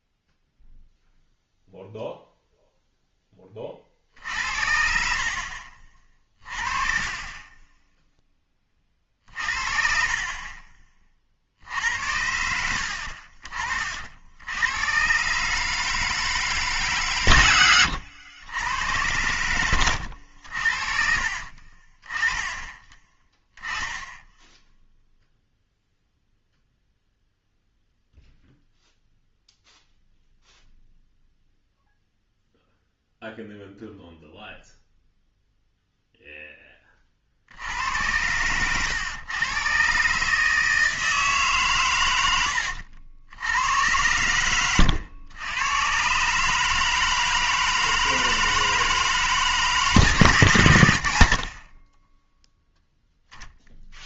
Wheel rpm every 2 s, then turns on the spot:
0, 0, 60, 30, 20, 40, 80, 90, 150, 90, 60, 20, 0, 0, 0, 0, 0, 0, 10, 100, 150, 80, 100, 150, 160, 120, 0.
42-44